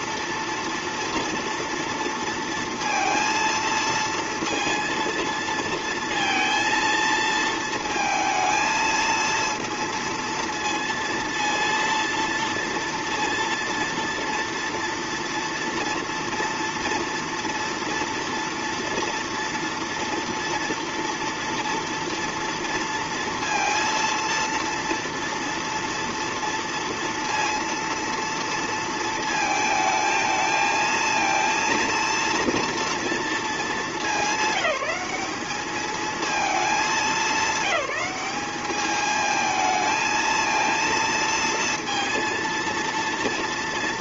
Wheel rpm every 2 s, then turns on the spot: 230, 230, 230, 230, 220, 230, 230, 230, 230, 230, 230, 230, 230, 230, 230, 220, 230, 200, 210, 210, 230, 230.
none